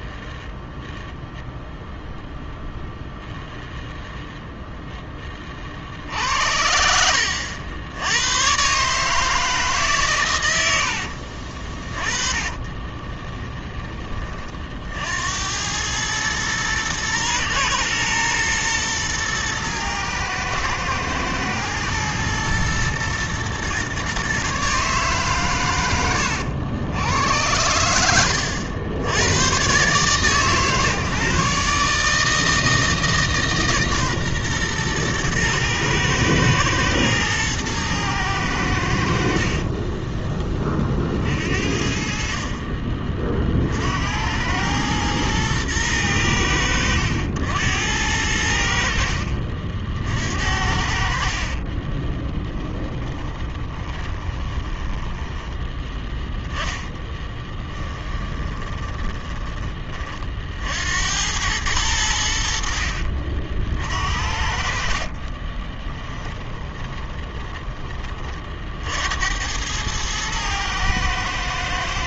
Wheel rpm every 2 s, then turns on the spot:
0, 0, 0, 70, 130, 80, 30, 50, 110, 120, 110, 120, 140, 100, 90, 140, 160, 120, 110, 90, 30, 40, 100, 90, 70, 70, 10, 20, 10, 20, 60, 50, 50, 20, 50, 110.
10-14 52-56 58-60 66-68